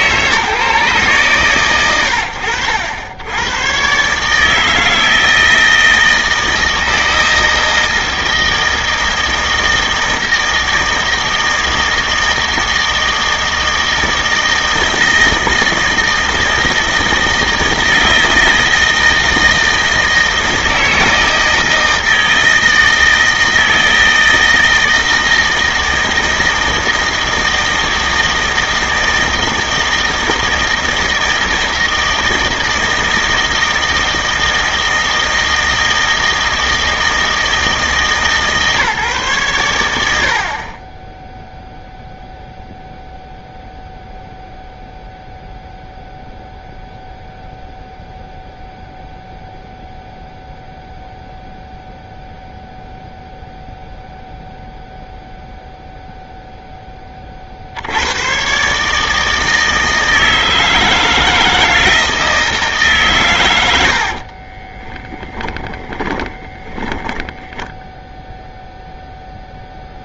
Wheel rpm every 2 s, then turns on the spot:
150, 90, 150, 160, 160, 160, 160, 160, 160, 160, 160, 160, 160, 160, 160, 160, 160, 160, 160, 150, 50, 0, 0, 0, 0, 0, 0, 0, 0, 120, 160, 160, 40, 10, 0.
64-68